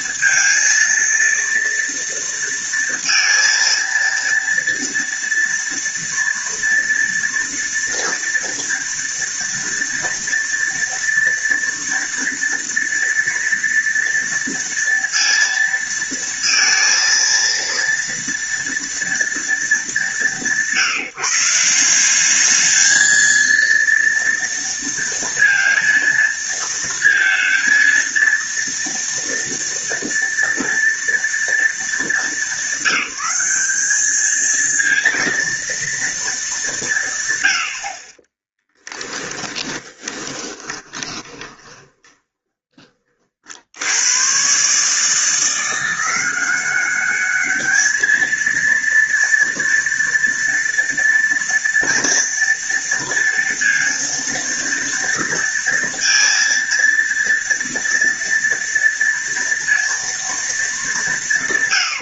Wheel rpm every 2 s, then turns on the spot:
230, 230, 230, 240, 230, 230, 230, 230, 230, 230, 160, 220, 230, 230, 230, 230, 200, 230, 180, 20, 20, 40, 140, 190, 230, 230, 230, 230, 230, 230, 210.
38-42